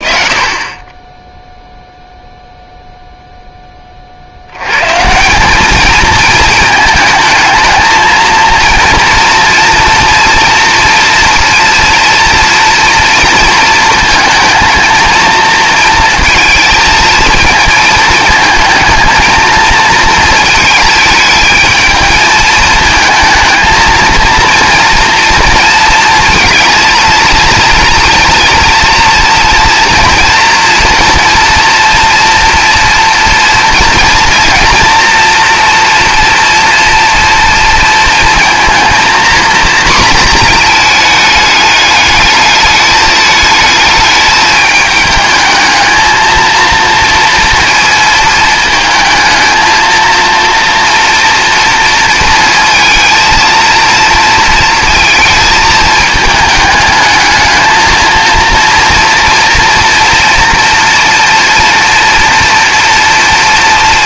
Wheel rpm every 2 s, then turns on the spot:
20, 0, 120, 220, 230, 230, 230, 220, 230, 220, 220, 220, 230, 230, 230, 230, 240, 230, 230, 230, 220, 210, 220, 230, 220, 230, 230, 230, 210, 230, 230, 230.
none